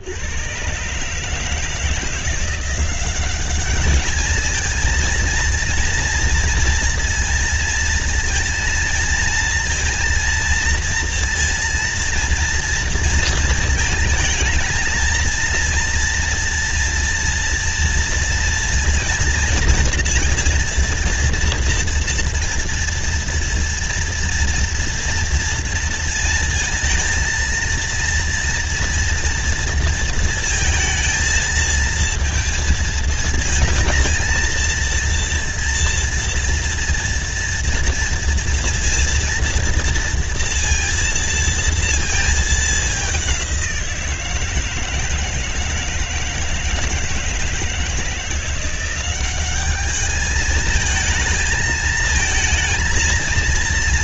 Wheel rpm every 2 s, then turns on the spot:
120, 180, 230, 230, 230, 230, 230, 220, 230, 230, 230, 230, 230, 230, 230, 230, 230, 230, 230, 230, 230, 210, 160, 160, 180, 220, 230.
none